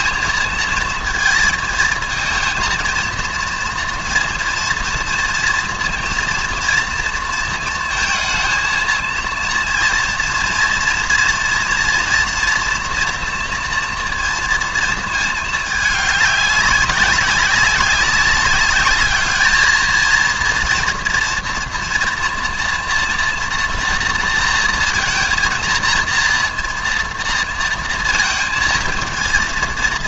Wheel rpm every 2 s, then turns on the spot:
220, 220, 230, 230, 220, 240, 240, 230, 200, 200, 240, 230, 230, 230, 230.
none